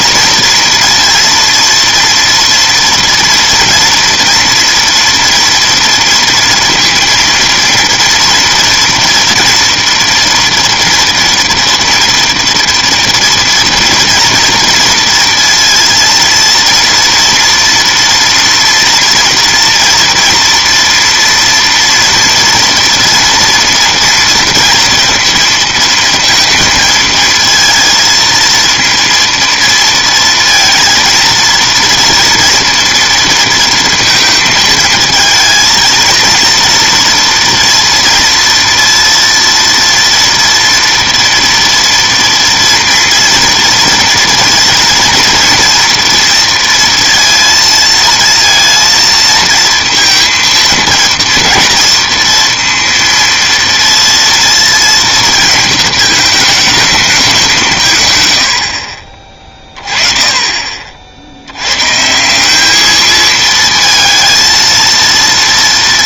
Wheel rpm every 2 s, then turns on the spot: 230, 230, 230, 230, 230, 230, 230, 230, 230, 230, 230, 230, 230, 220, 230, 230, 240, 220, 230, 230, 230, 230, 230, 230, 230, 230, 230, 230, 220, 60, 40, 210, 230.
none